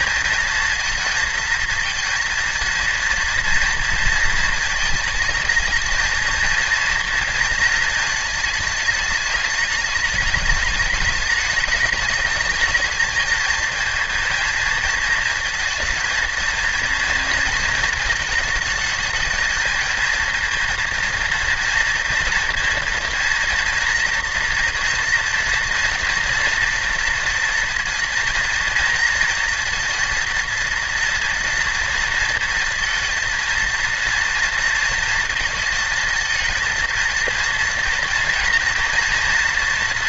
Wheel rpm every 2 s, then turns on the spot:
230, 230, 220, 230, 220, 210, 220, 230, 230, 220, 230, 230, 230, 230, 230, 230, 230, 230, 230, 230.
none